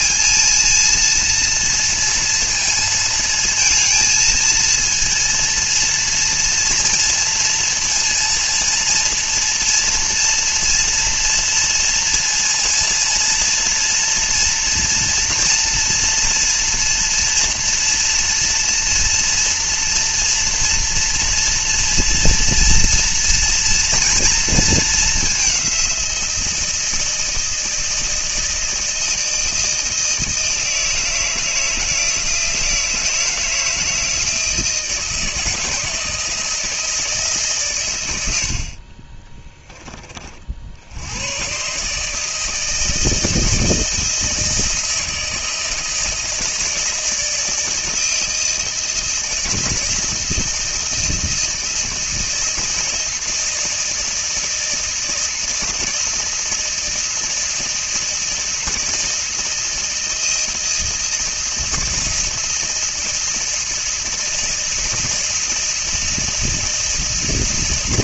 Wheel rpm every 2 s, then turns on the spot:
230, 230, 230, 230, 230, 230, 230, 240, 230, 230, 240, 230, 220, 160, 160, 160, 160, 160, 160, 40, 70, 160, 160, 160, 160, 160, 160, 160, 160, 160, 160, 160, 160, 160.
38-40